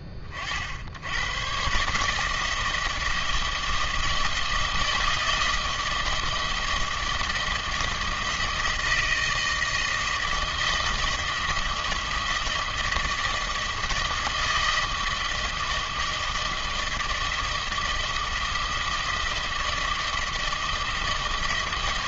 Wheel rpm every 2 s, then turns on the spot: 40, 160, 160, 160, 160, 160, 160, 160, 160, 160, 160.
none